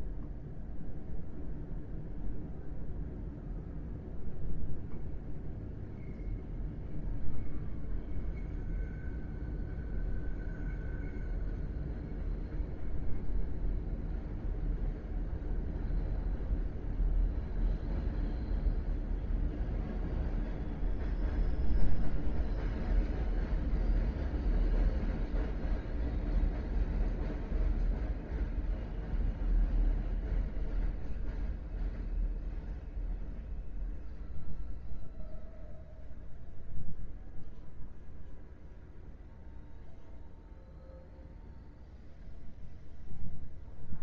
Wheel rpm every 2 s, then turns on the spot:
0, 0, 0, 0, 0, 0, 0, 0, 0, 0, 0, 0, 0, 0, 0, 0, 0, 0, 0, 0, 0, 0.
none